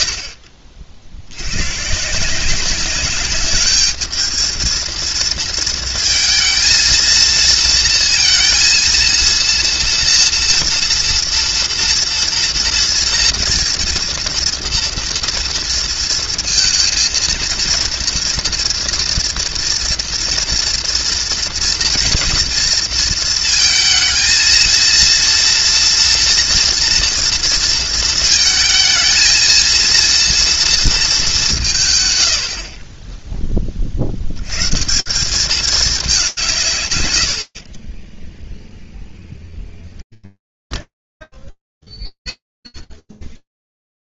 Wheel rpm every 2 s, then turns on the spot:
60, 200, 230, 230, 230, 230, 230, 230, 230, 230, 240, 230, 230, 230, 220, 200, 10, 170, 90, 0, 10, 30.
40-42